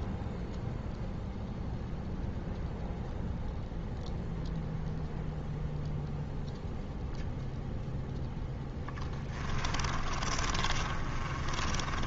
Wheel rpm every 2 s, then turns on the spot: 0, 0, 0, 0, 10, 30.
8-12